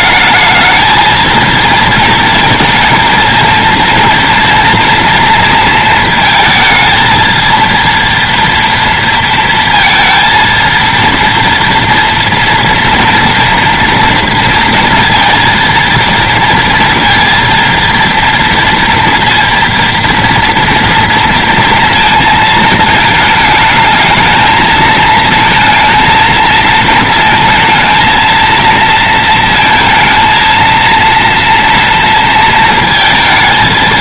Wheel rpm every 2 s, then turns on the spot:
230, 230, 240, 230, 230, 230, 230, 230, 230, 230, 230, 220, 220, 230, 230, 230, 230.
none